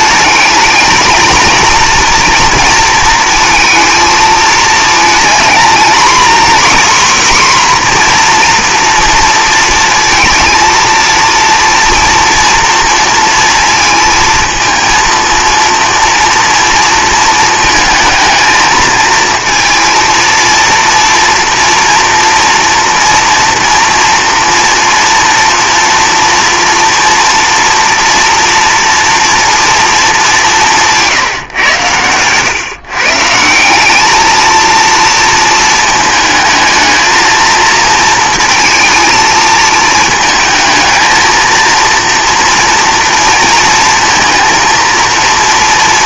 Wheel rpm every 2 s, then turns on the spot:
220, 230, 220, 260, 230, 230, 230, 220, 230, 220, 230, 230, 230, 240, 230, 170, 130, 220, 220, 230, 220, 240, 230.
none